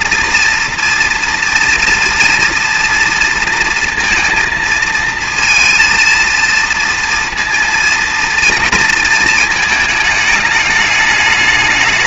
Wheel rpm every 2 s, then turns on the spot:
230, 230, 230, 230, 230, 210.
none